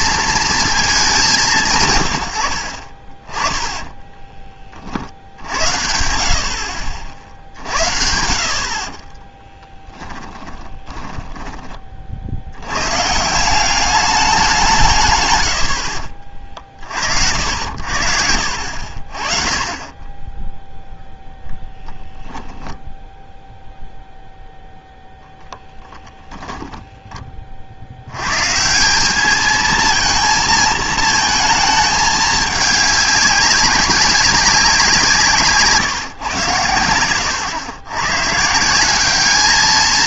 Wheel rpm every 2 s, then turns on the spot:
220, 50, 50, 60, 60, 10, 100, 170, 40, 60, 0, 0, 0, 10, 150, 220, 210, 180, 80, 170.
8-12 26-28